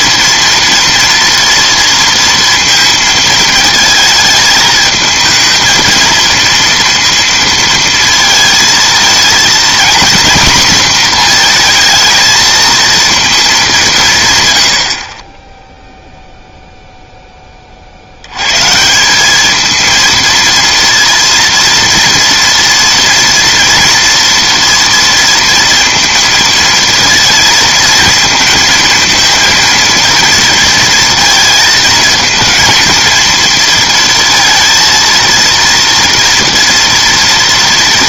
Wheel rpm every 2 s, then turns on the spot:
230, 230, 220, 230, 230, 240, 230, 120, 0, 130, 230, 230, 240, 230, 230, 230, 230, 230, 230.
none